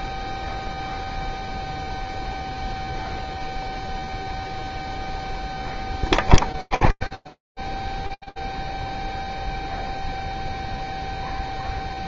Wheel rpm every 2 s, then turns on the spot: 0, 0, 0, 0, 0, 0.
none